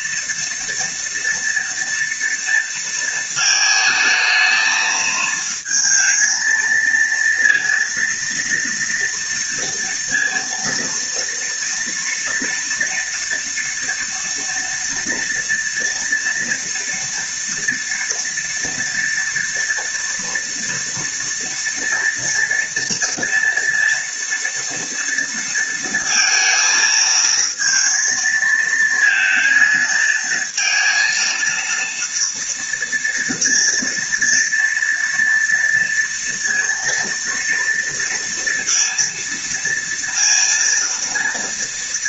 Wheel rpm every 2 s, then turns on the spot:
230, 230, 220, 230, 230, 230, 230, 230, 230, 230, 230, 230, 230, 230, 220, 230, 230, 230, 230, 230, 230.
none